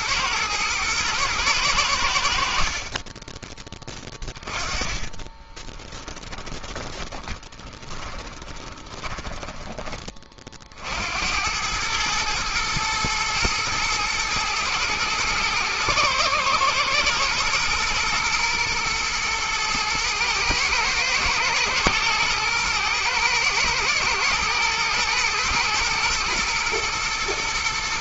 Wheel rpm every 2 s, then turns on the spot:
110, 50, 20, 20, 20, 40, 110, 110, 120, 120, 110, 110, 120, 120.
4-10